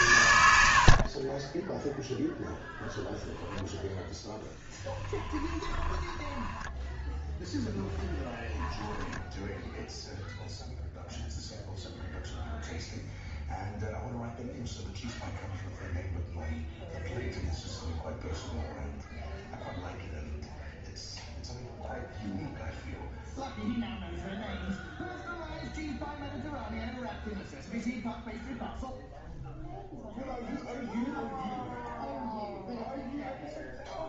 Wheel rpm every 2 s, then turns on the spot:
60, 10, 10, 10, 10, 0, 0, 0, 0, 0, 0, 0, 0, 0, 0, 0, 0.
0-2 4-10